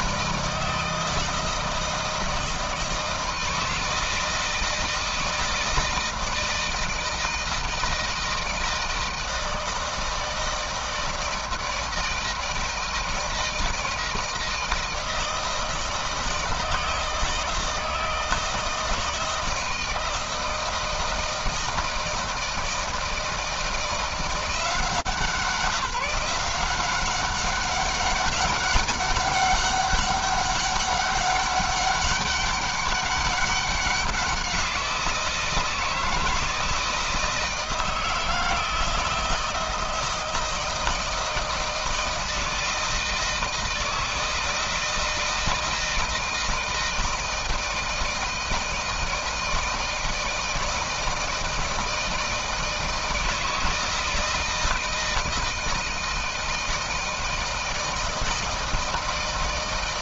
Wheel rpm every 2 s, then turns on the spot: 160, 160, 160, 160, 160, 160, 160, 160, 160, 160, 160, 160, 180, 180, 200, 200, 200, 180, 160, 160, 160, 160, 160, 160, 160, 160, 160, 160, 160, 160.
none